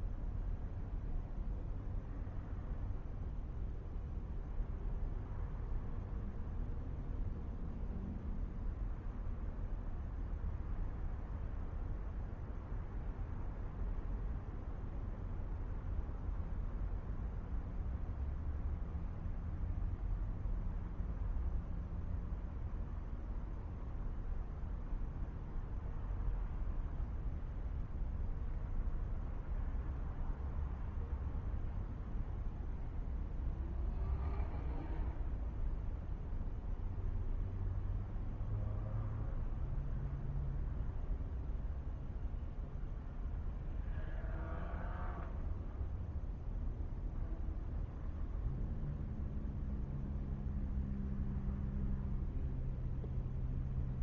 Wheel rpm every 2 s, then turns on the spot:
0, 0, 0, 0, 0, 0, 0, 0, 0, 0, 0, 0, 0, 0, 0, 0, 0, 0, 0, 0, 0, 0, 0, 0, 0, 0, 0.
none